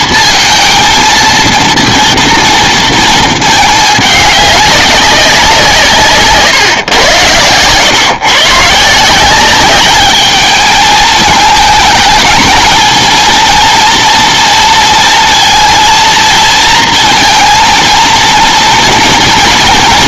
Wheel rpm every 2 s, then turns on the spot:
220, 230, 210, 140, 140, 210, 220, 230, 230, 230.
none